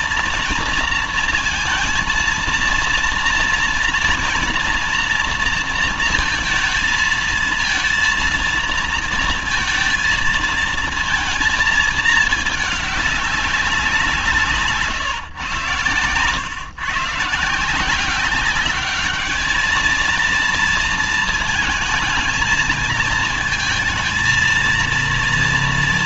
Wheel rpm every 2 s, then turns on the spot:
230, 230, 240, 230, 230, 230, 210, 150, 130, 200, 230, 220, 230.
none